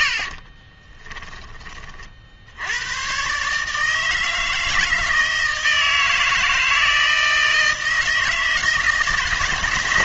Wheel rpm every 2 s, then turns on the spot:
30, 90, 160, 160, 160.
0-2